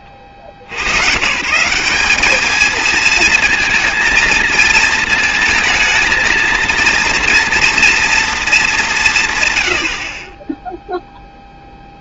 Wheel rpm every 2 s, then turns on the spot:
60, 220, 230, 230, 190, 0.
none